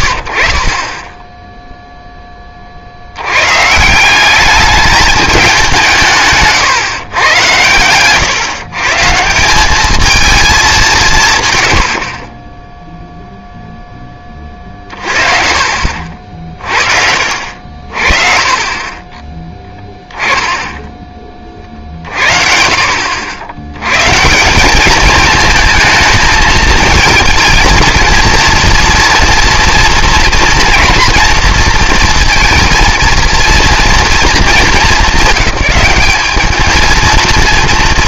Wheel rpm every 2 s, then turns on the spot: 60, 30, 210, 140, 140, 200, 10, 30, 50, 40, 10, 70, 180, 220, 230, 240, 230, 200, 220.
18-20